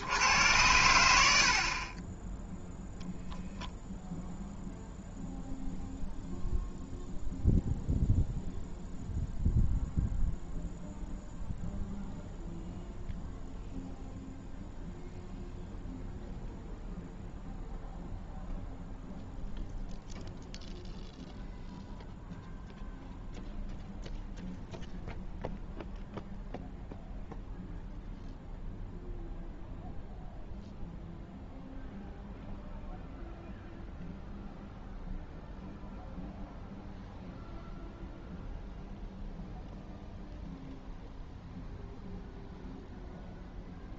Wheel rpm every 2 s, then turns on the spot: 90, 0, 0, 0, 0, 0, 0, 0, 0, 0, 0, 0, 0, 0, 0, 0, 0, 0, 0, 0, 0, 0.
none